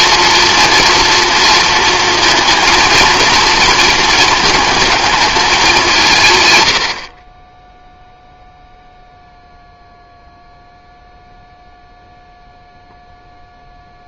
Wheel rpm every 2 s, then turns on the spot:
230, 230, 220, 110, 0, 0, 0.
none